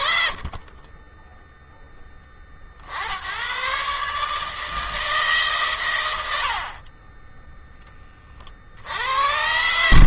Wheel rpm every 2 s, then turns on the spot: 10, 130, 120, 20, 80.
none